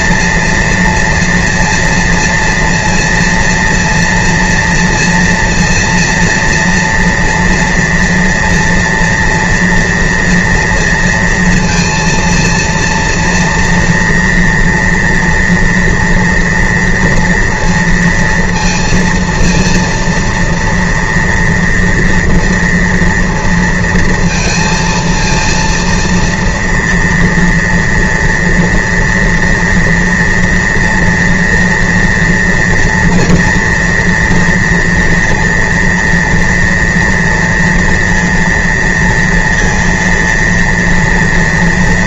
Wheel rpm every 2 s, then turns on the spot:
230, 230, 240, 230, 230, 230, 230, 230, 230, 230, 230, 230, 230, 230, 230, 230, 230, 240, 230, 230, 230.
none